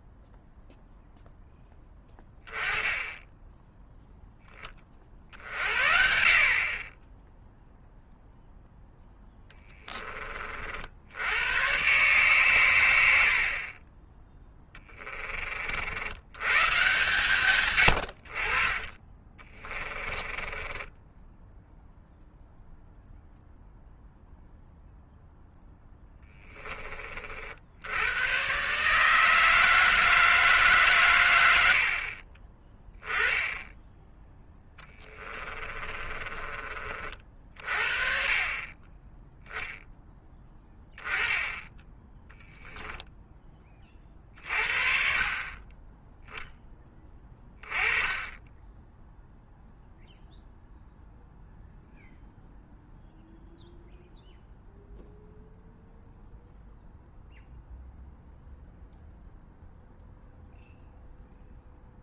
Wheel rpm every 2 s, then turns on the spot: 0, 20, 40, 20, 10, 80, 100, 20, 130, 40, 20, 0, 0, 30, 150, 140, 10, 10, 40, 20, 10, 10, 50, 10, 10, 0, 0, 0, 0, 0, 0.
14-16 18-22 34-36